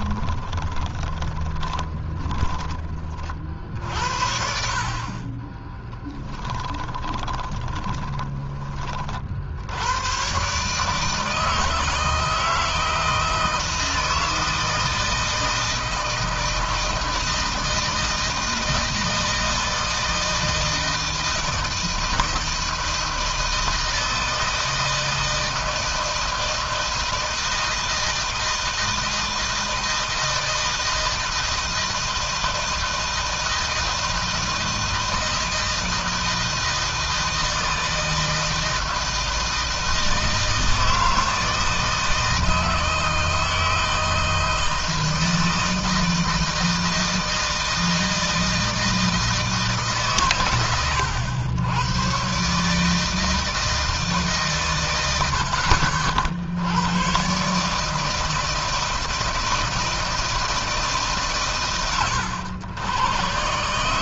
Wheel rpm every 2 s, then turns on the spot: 20, 30, 40, 10, 40, 150, 160, 160, 160, 160, 160, 160, 160, 160, 160, 160, 160, 160, 160, 160, 160, 160, 160, 160, 160, 90, 150, 100, 100, 160, 140, 130.
0-2 6-8